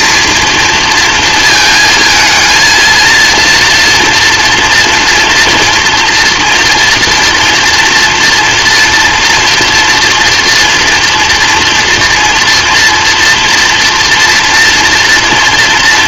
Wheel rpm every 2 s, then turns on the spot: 230, 230, 230, 240, 230, 230, 240, 230.
none